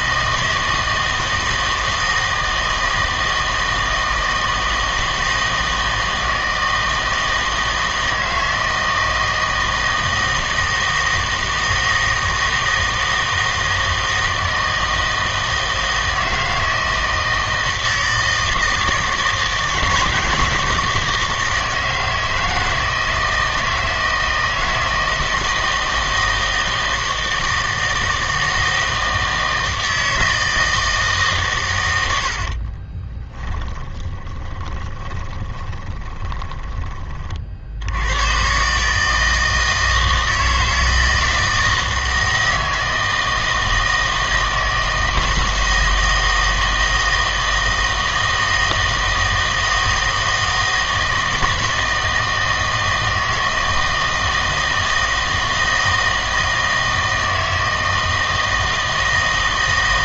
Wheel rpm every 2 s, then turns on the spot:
160, 160, 160, 160, 160, 160, 160, 160, 160, 160, 160, 160, 160, 160, 160, 160, 40, 20, 20, 140, 160, 160, 160, 160, 160, 160, 160, 160, 160, 160.
32-36